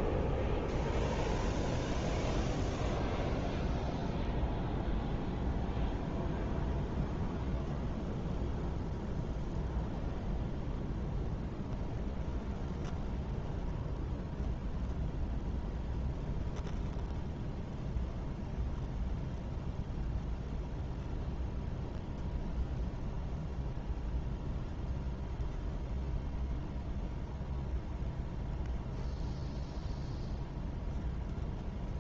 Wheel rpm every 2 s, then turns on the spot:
0, 0, 0, 0, 0, 0, 0, 0, 0, 0, 0, 0, 0, 0, 0, 0.
none